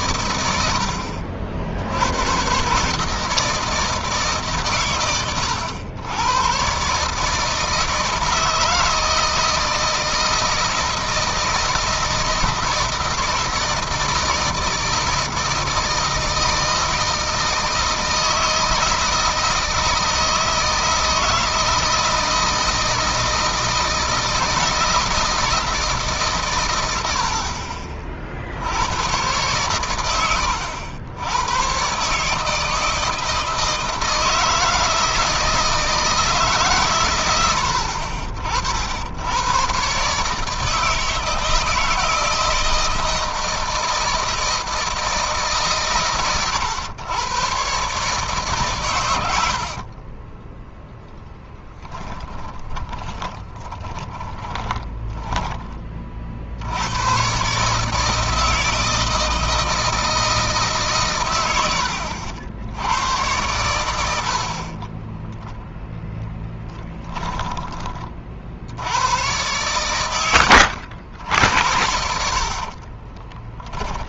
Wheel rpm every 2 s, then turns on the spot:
100, 120, 140, 130, 160, 170, 160, 160, 160, 160, 160, 160, 160, 110, 90, 90, 160, 160, 140, 60, 160, 160, 160, 110, 130, 10, 10, 20, 80, 160, 150, 90, 40, 10, 70, 80, 40.
50-56 64-68 72-74